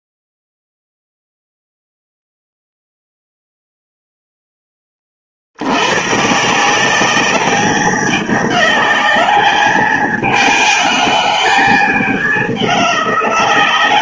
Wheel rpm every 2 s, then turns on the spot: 0, 0, 10, 150, 200, 200, 200.
none